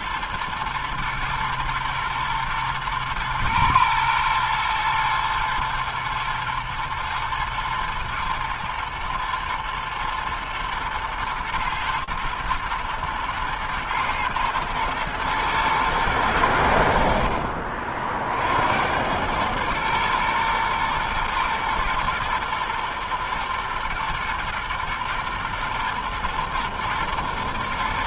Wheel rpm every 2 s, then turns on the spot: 110, 120, 110, 120, 110, 110, 110, 110, 100, 60, 120, 120, 120, 110.
none